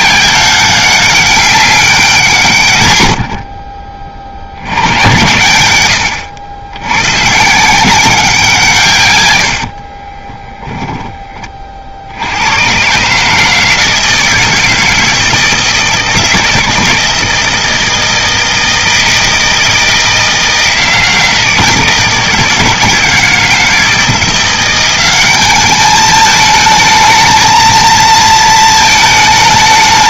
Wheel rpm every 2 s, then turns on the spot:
200, 100, 100, 100, 140, 20, 130, 160, 160, 160, 160, 160, 190, 220, 220.
none